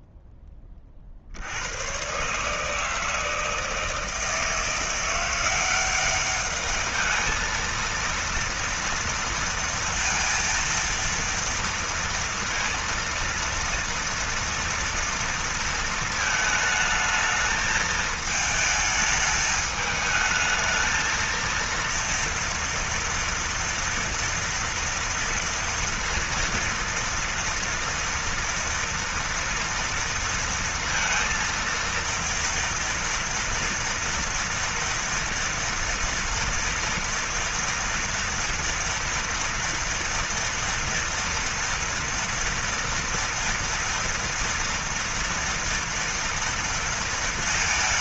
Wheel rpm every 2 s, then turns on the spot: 20, 150, 170, 210, 230, 230, 230, 230, 220, 220, 220, 230, 230, 230, 230, 230, 230, 230, 230, 230, 230, 230, 230, 230.
none